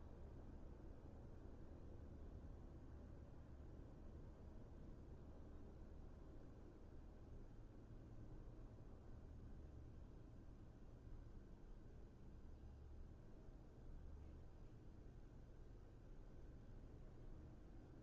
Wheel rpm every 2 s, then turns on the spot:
0, 0, 0, 0, 0, 0, 0, 0, 0.
none